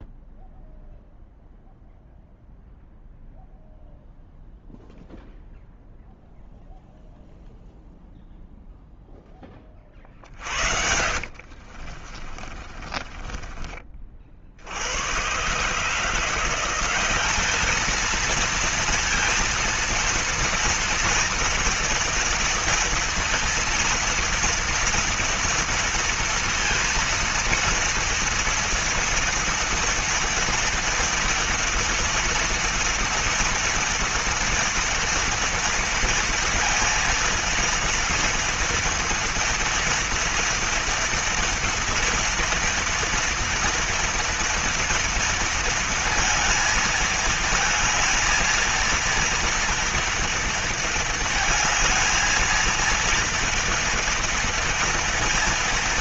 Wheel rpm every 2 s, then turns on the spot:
0, 0, 0, 0, 0, 50, 30, 50, 170, 230, 230, 230, 230, 230, 230, 230, 230, 230, 230, 240, 240, 230, 230, 220, 220, 230, 220, 230.
10-14